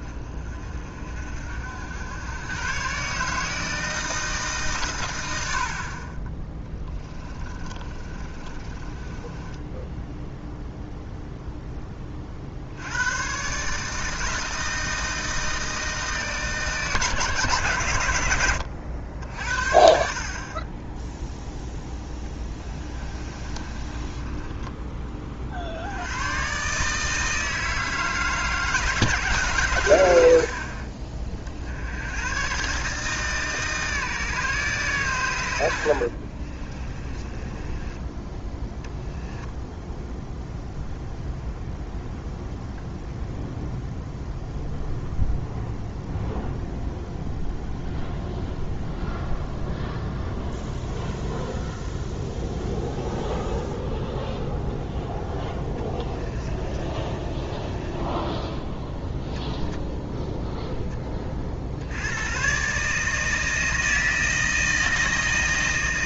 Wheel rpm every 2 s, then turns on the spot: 50, 130, 130, 10, 30, 0, 90, 160, 150, 80, 20, 20, 20, 140, 160, 40, 150, 140, 30, 10, 0, 0, 0, 0, 0, 0, 0, 0, 20, 0, 10, 140, 160.
6-10 22-24 36-38 56-58